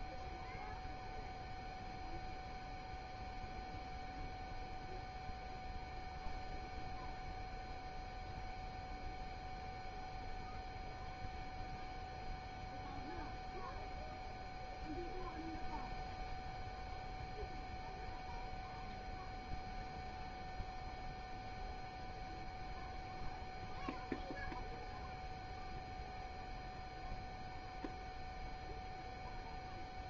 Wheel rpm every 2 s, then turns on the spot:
0, 0, 0, 0, 0, 0, 0, 0, 0, 0, 0, 0, 0, 0, 0.
none